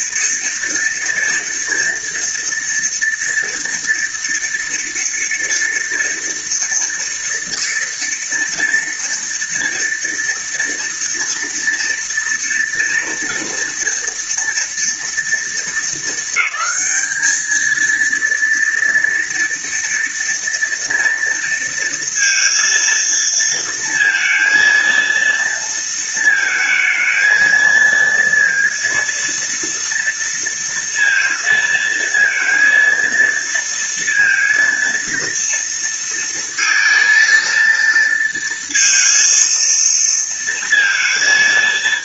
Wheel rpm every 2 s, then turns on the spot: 240, 230, 230, 230, 230, 230, 230, 230, 220, 230, 230, 230, 230, 220, 230, 230, 230, 230, 230, 230, 220.
none